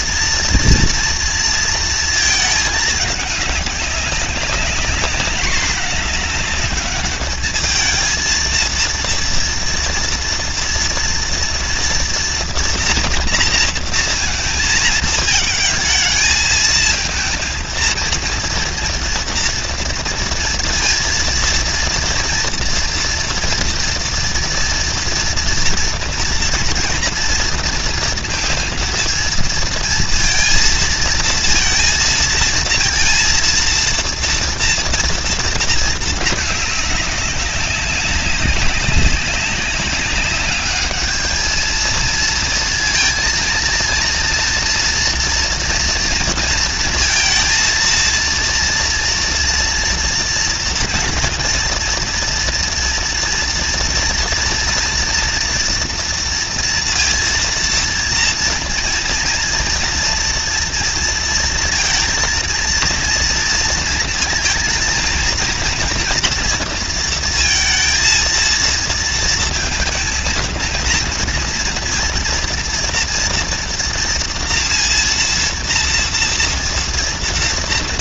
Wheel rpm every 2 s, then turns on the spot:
230, 210, 210, 210, 230, 230, 230, 220, 220, 230, 230, 240, 230, 230, 230, 230, 230, 230, 200, 190, 210, 230, 230, 230, 230, 230, 230, 230, 230, 230, 230, 230, 230, 230, 230, 230, 240, 230, 230.
none